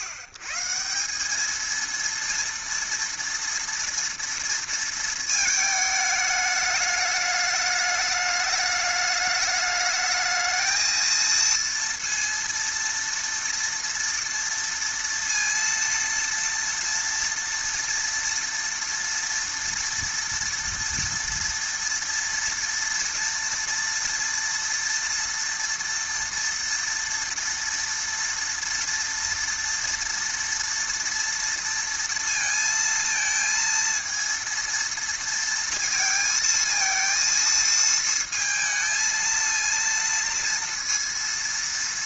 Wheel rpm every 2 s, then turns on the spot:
120, 230, 230, 210, 210, 220, 230, 230, 230, 240, 230, 230, 230, 230, 230, 230, 230, 230, 230, 220, 230.
none